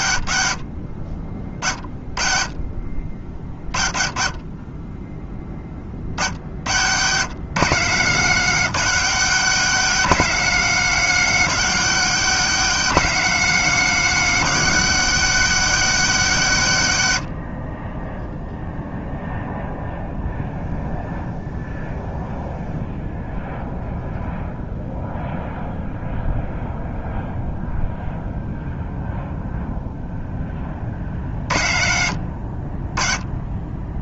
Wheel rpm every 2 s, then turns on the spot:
60, 50, 20, 90, 180, 200, 190, 190, 140, 0, 0, 0, 0, 0, 0, 30, 50.
none